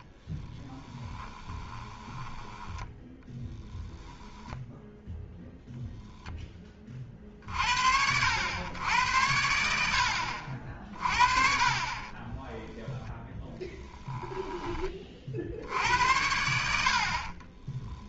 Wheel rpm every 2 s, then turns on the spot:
10, 10, 0, 30, 100, 50, 10, 20, 60.
0-4